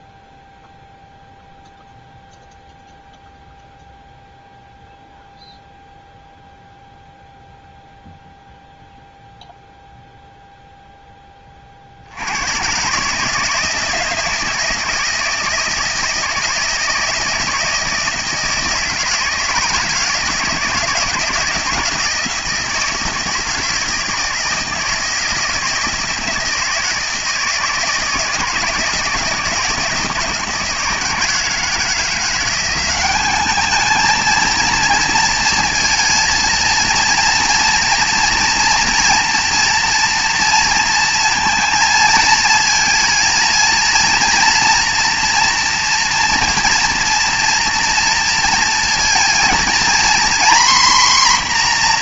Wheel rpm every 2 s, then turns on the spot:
0, 0, 0, 0, 0, 0, 120, 160, 160, 160, 160, 160, 160, 160, 160, 160, 180, 230, 230, 230, 230, 220, 240, 230, 230, 250.
none